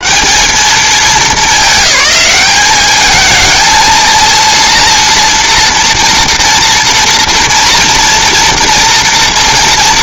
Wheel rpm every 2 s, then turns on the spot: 210, 210, 230, 230, 230.
none